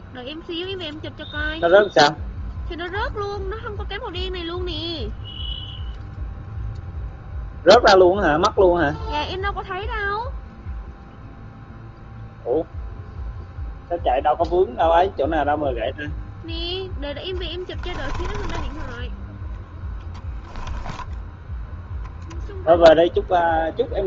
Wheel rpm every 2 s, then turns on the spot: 0, 0, 0, 0, 0, 0, 0, 0, 10, 10, 0, 0.
16-20